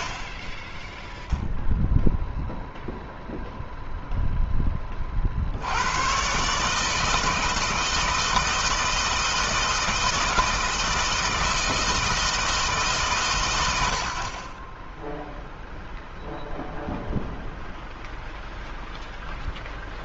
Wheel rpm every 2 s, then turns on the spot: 0, 0, 30, 150, 160, 160, 140, 10, 0, 0.
none